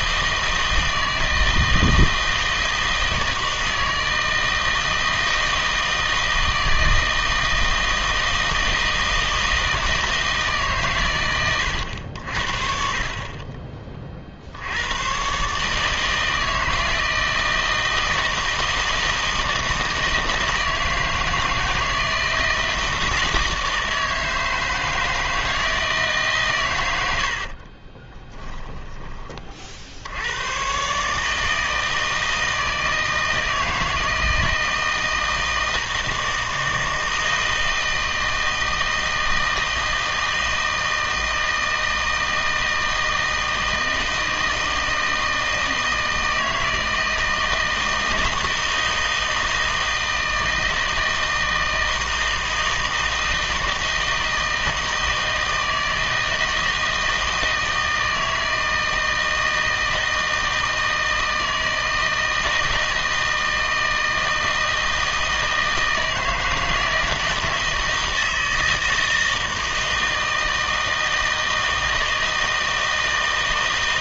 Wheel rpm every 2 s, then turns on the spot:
160, 160, 160, 160, 160, 140, 40, 70, 160, 160, 160, 160, 160, 120, 10, 120, 160, 160, 160, 160, 160, 160, 160, 160, 160, 160, 160, 160, 160, 160, 160, 160, 160, 160, 160, 160, 160.
28-30